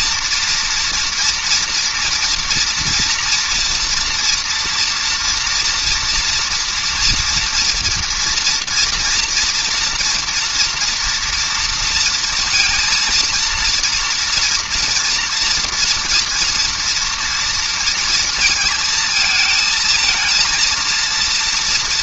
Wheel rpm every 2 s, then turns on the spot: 230, 230, 240, 230, 240, 230, 230, 230, 230, 220, 230.
none